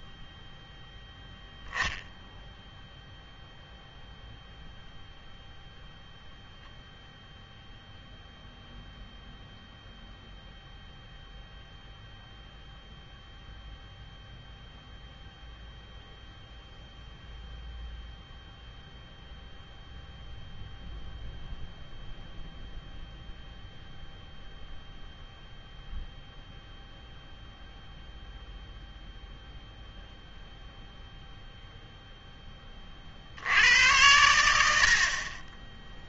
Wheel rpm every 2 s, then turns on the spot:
0, 0, 0, 0, 0, 0, 0, 0, 0, 0, 0, 0, 0, 0, 0, 0, 20, 70.
none